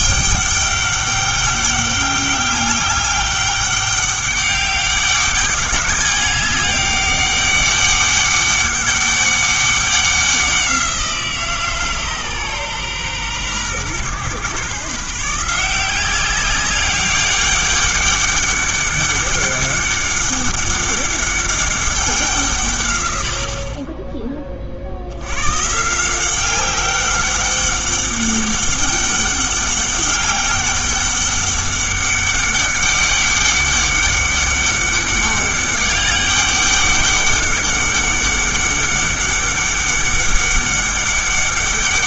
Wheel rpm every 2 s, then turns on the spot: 200, 200, 200, 200, 200, 180, 130, 140, 190, 200, 200, 140, 40, 190, 200, 200, 200, 200, 200, 200, 200.
none